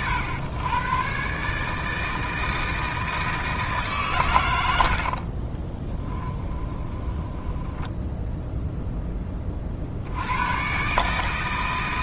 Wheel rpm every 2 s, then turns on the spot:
120, 160, 90, 20, 0, 120.
4-8